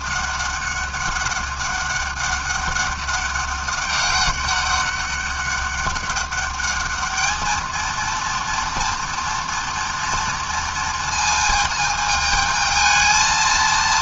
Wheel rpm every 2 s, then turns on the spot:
200, 200, 200, 220, 230, 230, 220.
none